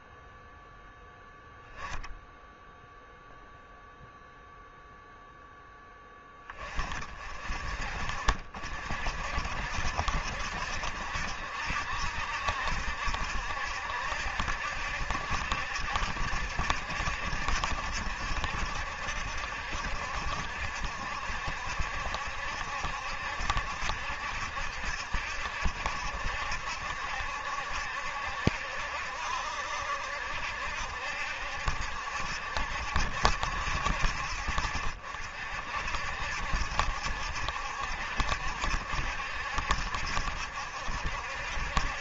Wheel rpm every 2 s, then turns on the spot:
0, 0, 0, 30, 50, 70, 70, 70, 70, 70, 70, 70, 70, 70, 70, 70, 70, 60, 70, 70, 60.
none